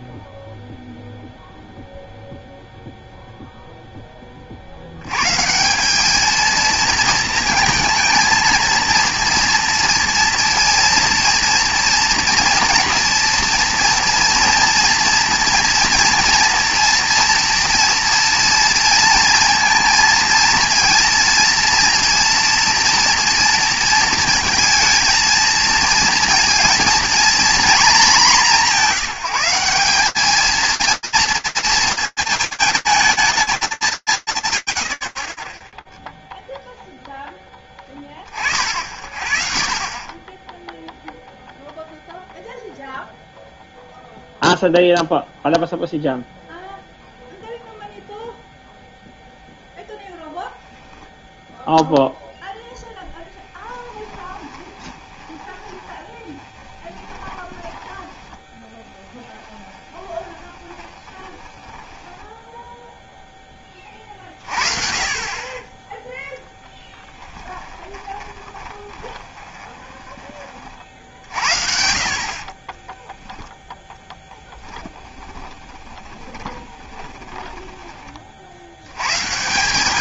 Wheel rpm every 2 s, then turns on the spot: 0, 0, 70, 230, 230, 230, 240, 230, 230, 230, 230, 230, 230, 230, 190, 220, 120, 10, 40, 0, 0, 0, 0, 0, 0, 0, 10, 30, 20, 20, 10, 40, 10, 30, 30, 40, 0, 20, 60, 170.
52-62 64-68 74-76